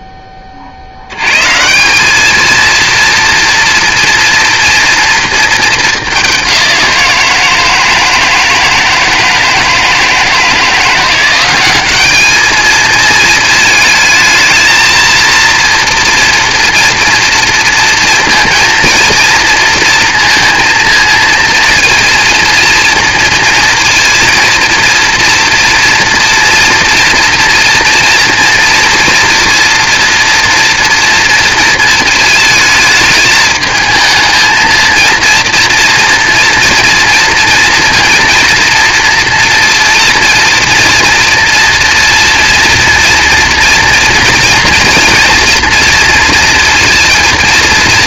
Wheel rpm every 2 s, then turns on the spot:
50, 220, 230, 190, 160, 160, 220, 220, 230, 230, 230, 230, 230, 230, 230, 230, 220, 230, 230, 230, 230, 230, 230, 230.
none